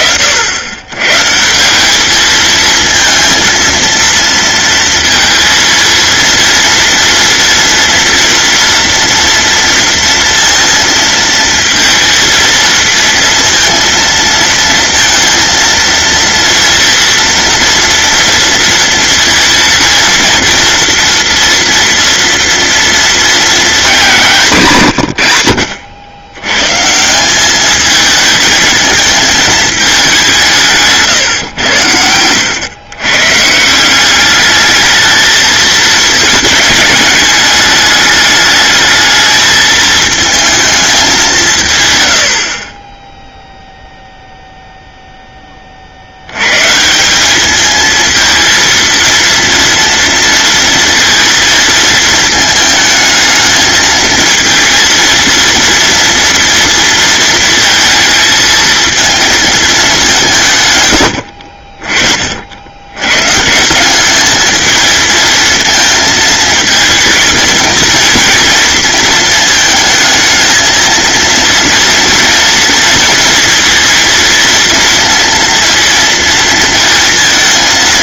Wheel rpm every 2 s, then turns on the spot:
110, 220, 230, 230, 230, 230, 230, 230, 240, 230, 230, 230, 140, 150, 220, 160, 120, 220, 210, 210, 210, 30, 0, 160, 230, 230, 220, 230, 230, 220, 110, 90, 220, 220, 230, 230, 230, 230, 230.
none